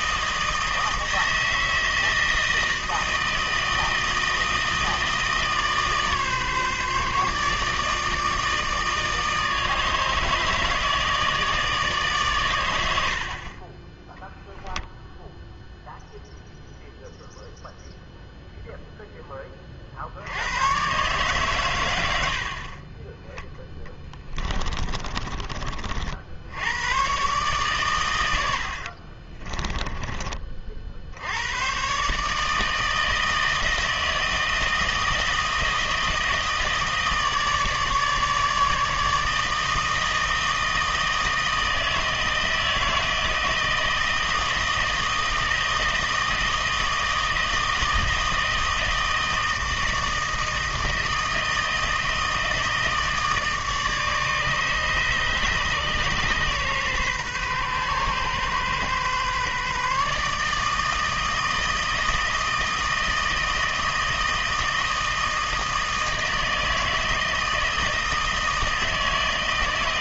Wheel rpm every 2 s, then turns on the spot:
160, 160, 160, 150, 160, 160, 100, 10, 0, 0, 100, 50, 20, 100, 80, 50, 160, 160, 160, 150, 160, 160, 160, 160, 160, 160, 160, 150, 130, 130, 150, 160, 160, 160, 160.
24-26 28-30